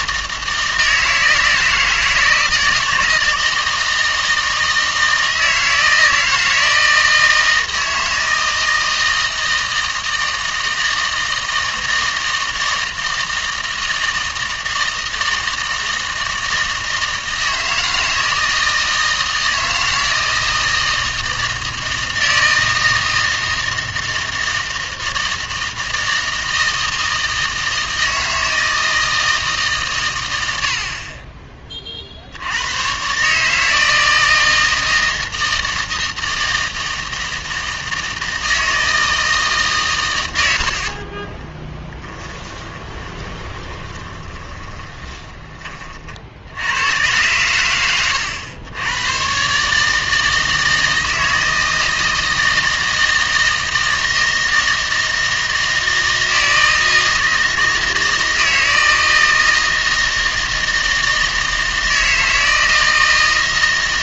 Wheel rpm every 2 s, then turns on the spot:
160, 160, 160, 160, 160, 160, 160, 160, 160, 160, 160, 160, 160, 160, 160, 80, 100, 160, 160, 160, 90, 20, 20, 90, 100, 160, 160, 160, 160, 160, 160, 160.
42-46